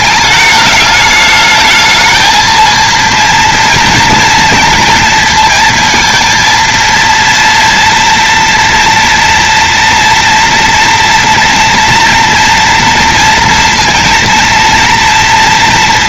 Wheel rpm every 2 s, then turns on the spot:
210, 230, 230, 230, 230, 230, 230, 230.
none